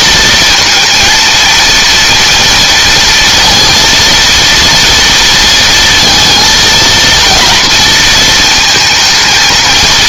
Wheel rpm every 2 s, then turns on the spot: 220, 230, 230, 230, 220.
none